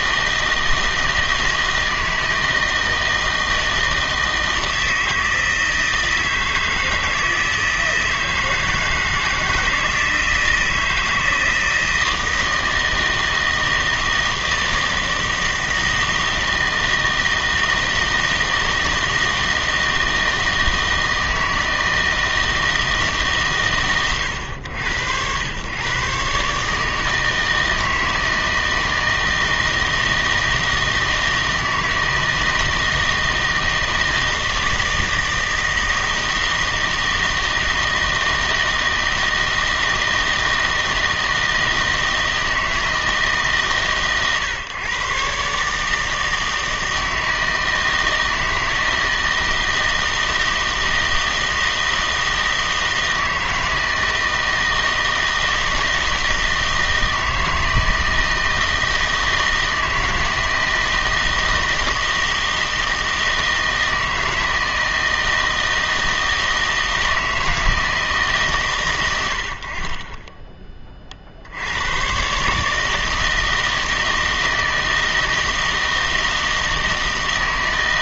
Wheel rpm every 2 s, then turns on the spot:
160, 160, 160, 160, 160, 160, 160, 160, 160, 160, 160, 160, 90, 150, 160, 160, 160, 160, 160, 160, 160, 160, 130, 160, 160, 160, 160, 160, 160, 160, 160, 160, 160, 160, 130, 20, 150, 160, 160.
none